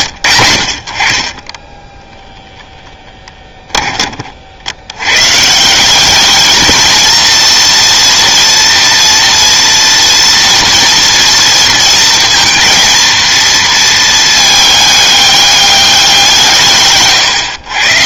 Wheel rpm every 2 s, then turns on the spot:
60, 0, 70, 220, 230, 230, 230, 210, 150.
none